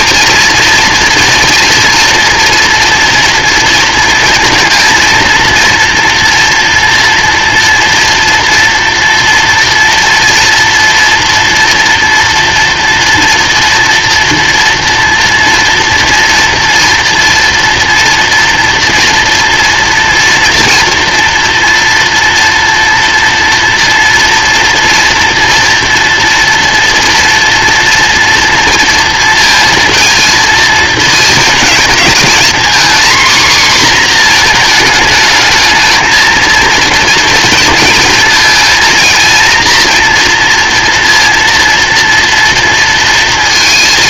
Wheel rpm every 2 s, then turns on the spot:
240, 230, 230, 240, 240, 230, 230, 230, 230, 230, 230, 230, 230, 230, 230, 230, 240, 230, 230, 230, 230, 230.
none